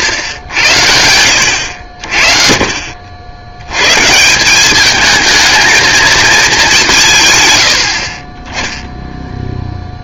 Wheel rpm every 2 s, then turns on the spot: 80, 60, 200, 180, 0.
none